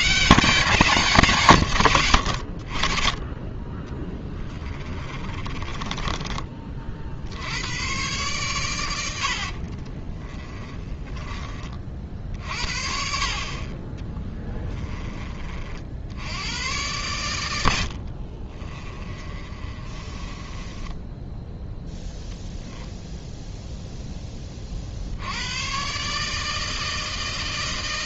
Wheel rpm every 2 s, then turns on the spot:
120, 130, 30, 30, 110, 20, 50, 20, 120, 30, 10, 0, 50, 160.
4-8 10-12 14-16 18-22